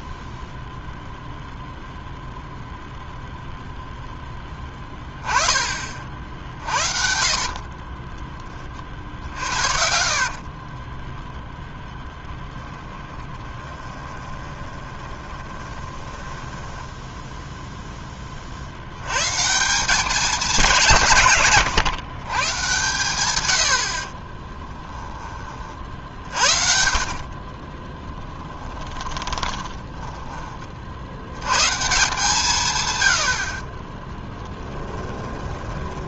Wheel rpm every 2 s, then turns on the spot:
0, 0, 20, 50, 40, 30, 10, 20, 10, 70, 200, 130, 10, 50, 10, 40, 130, 10.
6-8 10-12 14-18 24-30 34-36